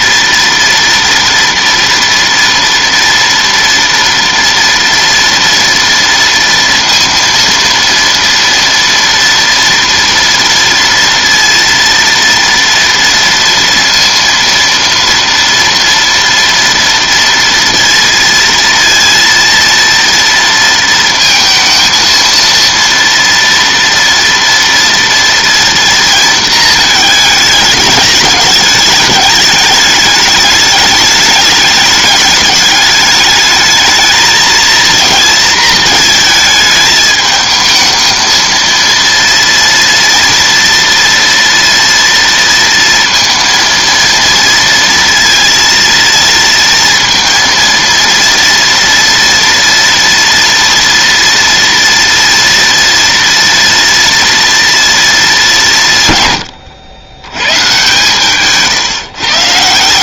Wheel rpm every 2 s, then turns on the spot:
230, 240, 230, 230, 230, 230, 230, 230, 230, 230, 230, 230, 230, 220, 210, 210, 210, 230, 220, 230, 230, 230, 230, 230, 230, 230, 230, 230, 110, 150.
none